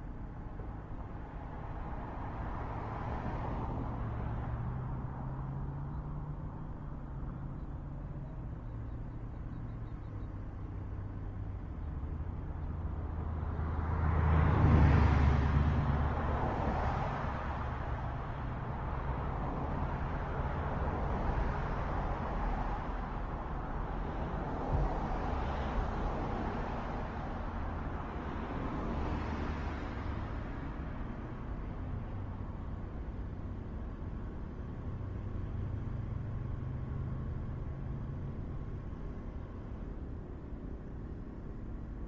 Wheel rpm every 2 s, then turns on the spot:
0, 0, 0, 0, 0, 0, 0, 0, 0, 0, 0, 0, 0, 0, 0, 0, 0, 0, 0, 0, 0.
none